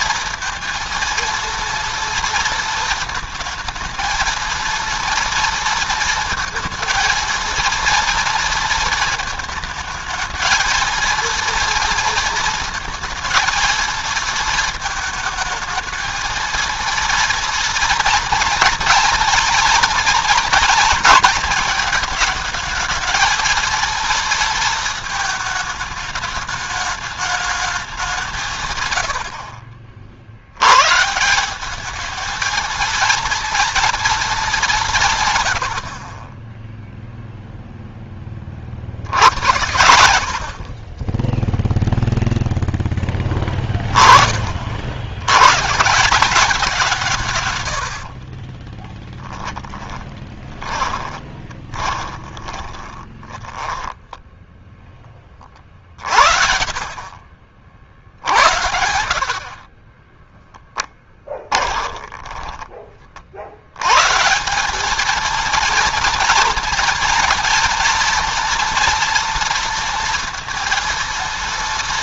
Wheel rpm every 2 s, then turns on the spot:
230, 230, 230, 230, 230, 220, 230, 220, 230, 230, 230, 220, 220, 210, 130, 120, 220, 180, 0, 60, 30, 10, 60, 180, 20, 30, 20, 10, 40, 70, 10, 30, 200, 230, 240, 230.
48-54 56-58 60-62